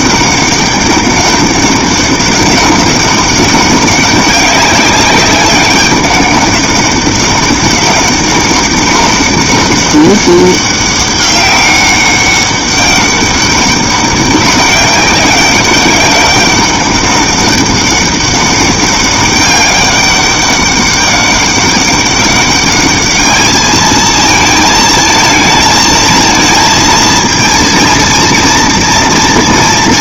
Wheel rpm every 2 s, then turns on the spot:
200, 200, 200, 200, 200, 200, 200, 200, 200, 200, 200, 200, 220, 230, 230.
none